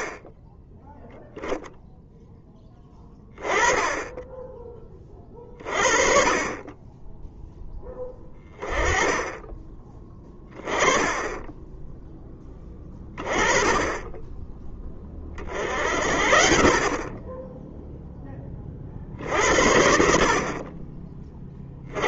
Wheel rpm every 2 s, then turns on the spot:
10, 10, 20, 10, 20, 20, 20, 20, 30, 40, 30.
none